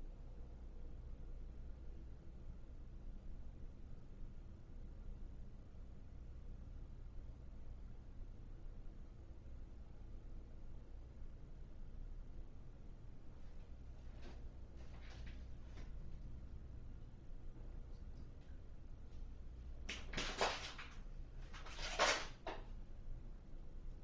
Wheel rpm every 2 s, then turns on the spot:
0, 0, 0, 0, 0, 0, 0, 0, 0, 0, 0, 0.
none